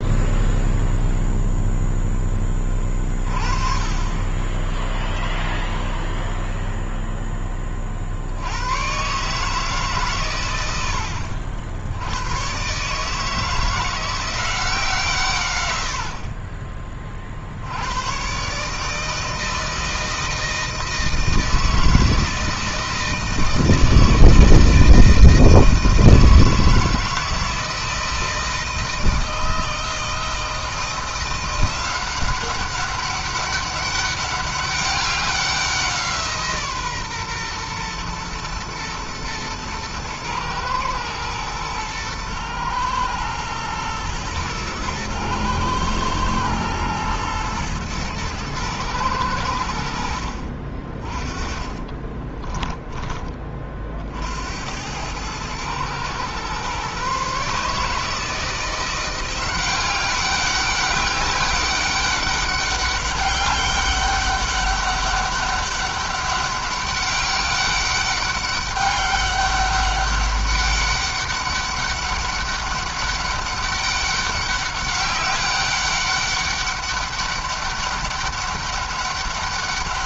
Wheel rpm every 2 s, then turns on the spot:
0, 20, 10, 0, 110, 110, 120, 170, 30, 140, 160, 160, 160, 160, 160, 170, 190, 200, 140, 120, 110, 110, 120, 110, 110, 40, 20, 90, 130, 170, 200, 200, 200, 200, 200, 200, 200, 200, 200, 200.
52-54